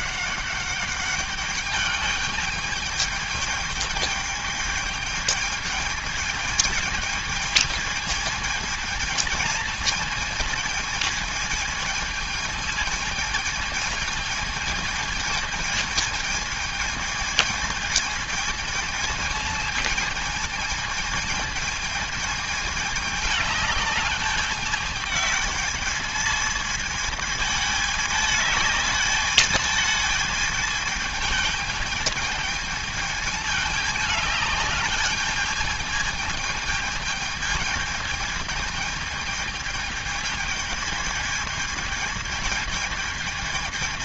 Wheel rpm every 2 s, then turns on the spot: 200, 210, 210, 220, 220, 220, 220, 220, 220, 220, 220, 210, 210, 220, 210, 220, 220, 210, 220, 220, 220, 220.
none